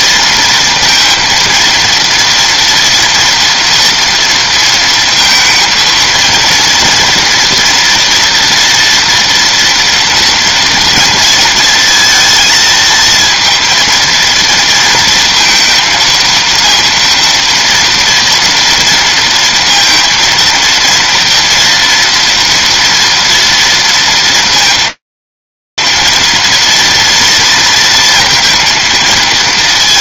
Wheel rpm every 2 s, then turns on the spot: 230, 230, 230, 230, 240, 240, 230, 230, 230, 230, 230, 230, 230, 230, 230.
none